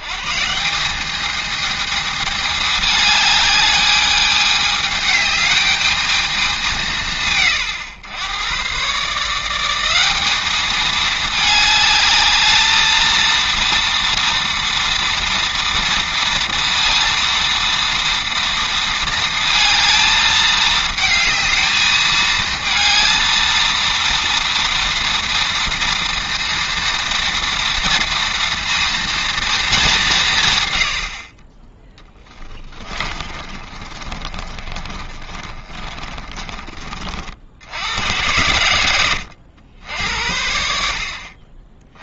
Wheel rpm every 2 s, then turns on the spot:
170, 210, 210, 170, 110, 210, 220, 230, 230, 230, 220, 220, 230, 230, 230, 120, 20, 40, 30, 100, 70.
32-36